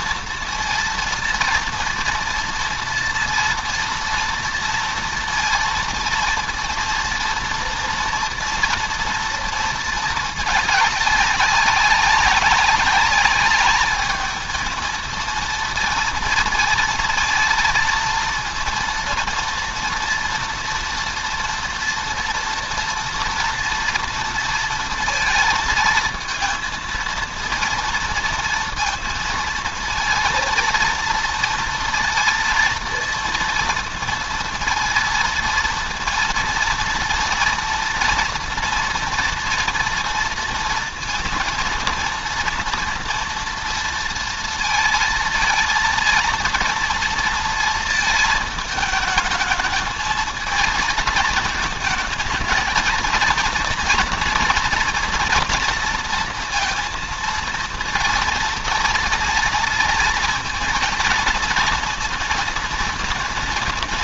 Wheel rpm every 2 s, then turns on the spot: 230, 230, 230, 230, 230, 210, 200, 220, 230, 230, 230, 230, 230, 230, 230, 230, 230, 230, 230, 230, 230, 230, 230, 230, 220, 220, 230, 230, 230, 230, 230, 230.
none